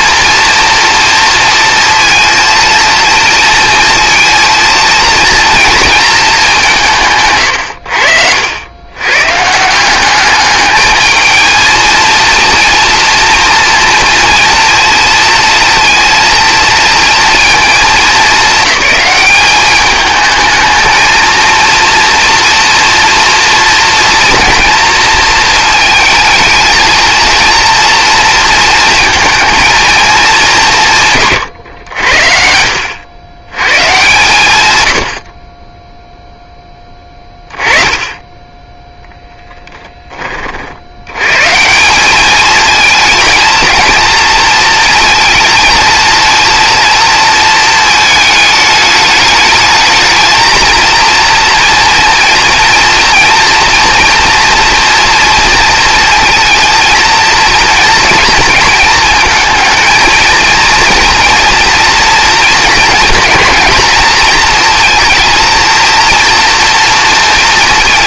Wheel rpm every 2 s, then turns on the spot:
230, 230, 230, 160, 110, 210, 240, 230, 230, 200, 220, 230, 230, 220, 230, 170, 80, 100, 10, 10, 80, 230, 230, 230, 210, 230, 230, 230, 230, 220, 230, 220, 230, 230.
none